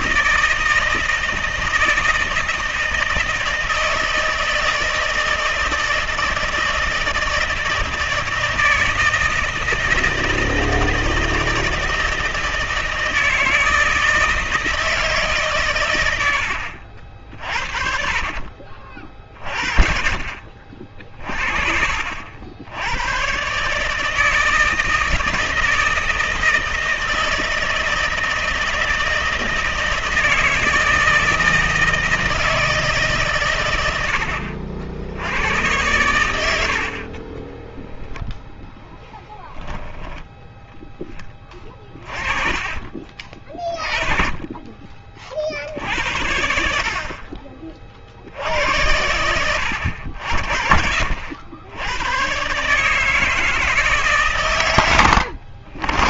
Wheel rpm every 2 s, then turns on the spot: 160, 160, 160, 160, 160, 160, 160, 160, 60, 30, 40, 90, 160, 160, 160, 160, 160, 80, 70, 10, 10, 30, 30, 60, 70, 60, 140, 110.
none